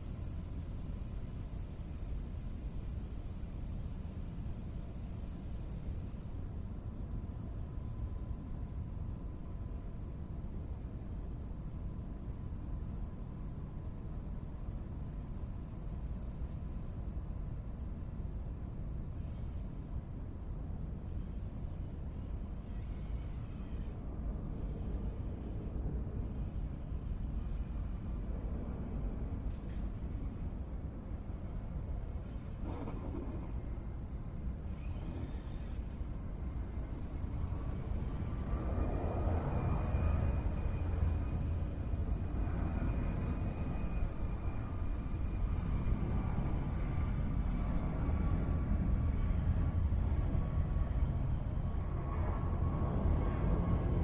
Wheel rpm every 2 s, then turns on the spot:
0, 0, 0, 0, 0, 0, 0, 0, 0, 0, 0, 0, 0, 0, 0, 0, 0, 0, 0, 0, 0, 0, 0, 0, 0, 0, 0.
none